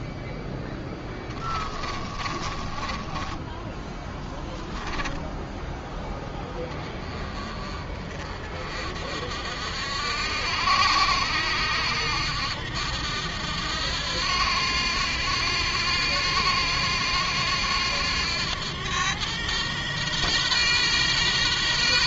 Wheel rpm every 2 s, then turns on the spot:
10, 20, 10, 20, 50, 80, 80, 90, 90, 100, 120.
0-6